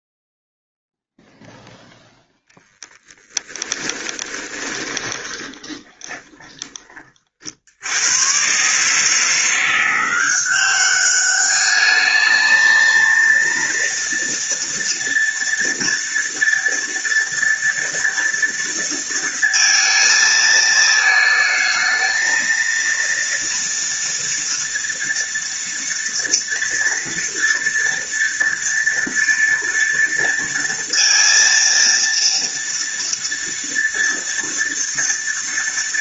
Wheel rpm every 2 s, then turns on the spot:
0, 10, 20, 30, 130, 190, 220, 230, 230, 230, 220, 230, 230, 230, 230, 230, 230, 230.
2-6